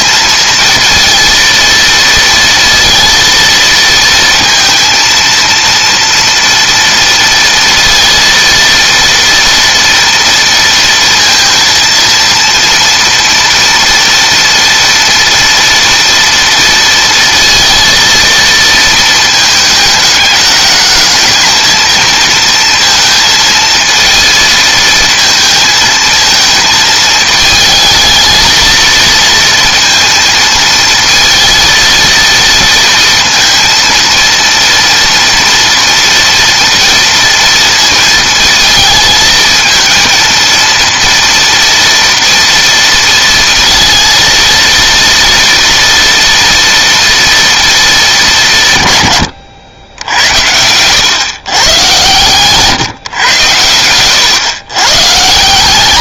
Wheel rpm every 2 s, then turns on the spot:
230, 230, 230, 230, 230, 230, 230, 230, 230, 230, 210, 230, 220, 220, 230, 230, 230, 230, 230, 230, 230, 230, 230, 230, 200, 90, 130, 120.
50-52